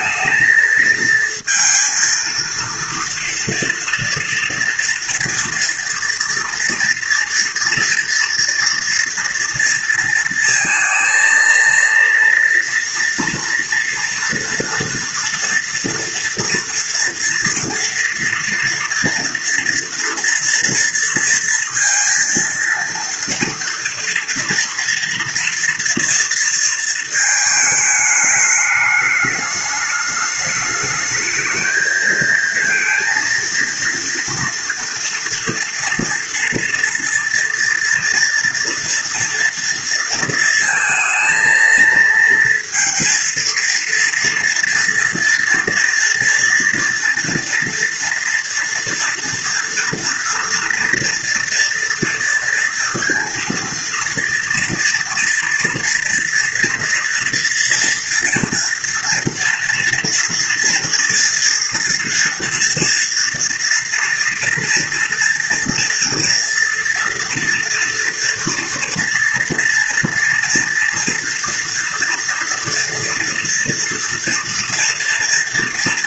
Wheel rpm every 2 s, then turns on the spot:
230, 230, 240, 230, 230, 230, 230, 230, 230, 230, 230, 230, 230, 230, 210, 210, 230, 230, 230, 240, 230, 230, 230, 230, 230, 240, 230, 240, 240, 230, 240, 230, 230, 230, 230, 230, 230, 230.
none